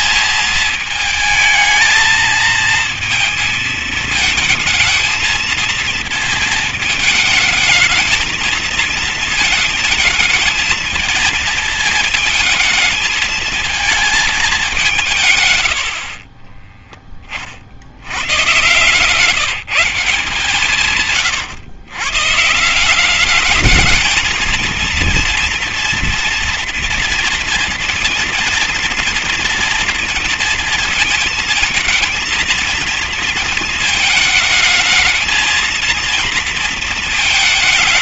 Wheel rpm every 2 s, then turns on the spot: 220, 220, 220, 220, 220, 220, 220, 210, 30, 120, 150, 160, 230, 230, 230, 230, 230, 220, 230.
16-18